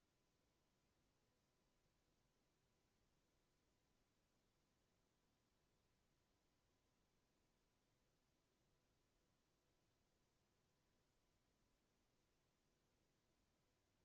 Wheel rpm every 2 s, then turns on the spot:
0, 0, 0, 0, 0, 0, 0.
none